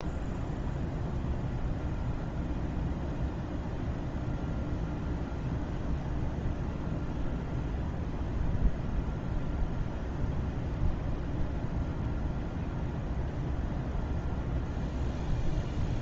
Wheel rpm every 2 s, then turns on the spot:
0, 0, 0, 0, 0, 0, 0, 0.
none